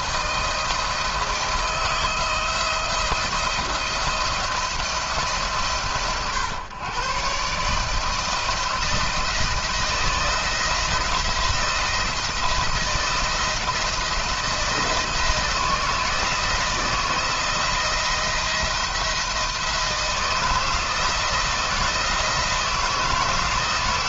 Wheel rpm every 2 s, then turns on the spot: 170, 170, 150, 140, 170, 170, 170, 160, 160, 160, 160, 160.
none